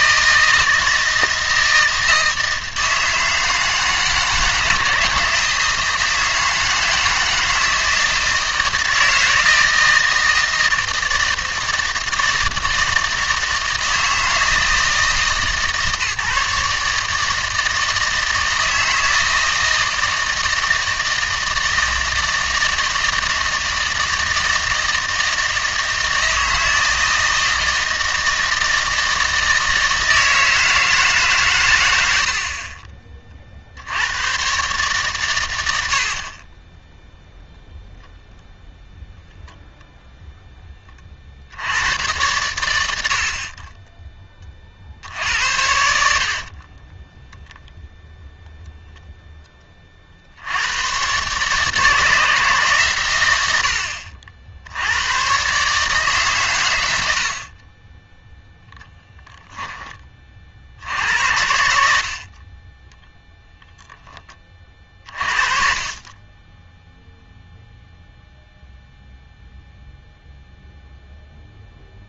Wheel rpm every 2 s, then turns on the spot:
160, 160, 160, 160, 160, 160, 160, 160, 150, 160, 160, 160, 160, 160, 160, 160, 40, 130, 20, 0, 10, 100, 40, 30, 0, 100, 150, 70, 110, 0, 60, 30, 30, 10, 0, 0.
46-48